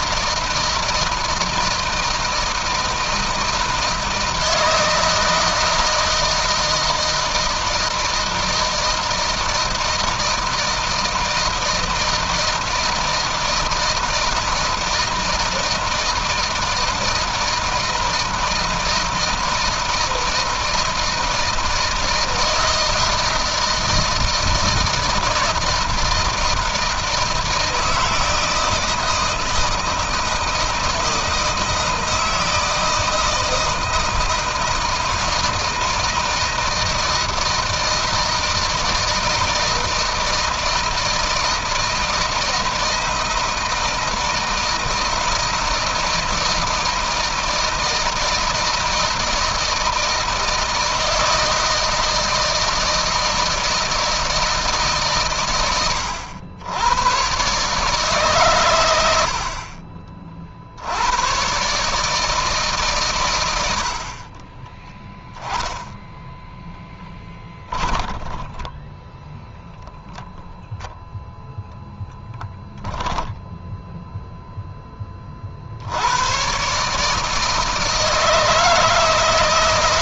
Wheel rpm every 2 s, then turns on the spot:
160, 160, 160, 160, 160, 160, 160, 160, 160, 160, 160, 160, 160, 160, 160, 160, 160, 160, 160, 160, 160, 160, 160, 160, 160, 160, 160, 140, 110, 100, 80, 130, 10, 10, 10, 0, 20, 20, 140, 160.
66-68 72-74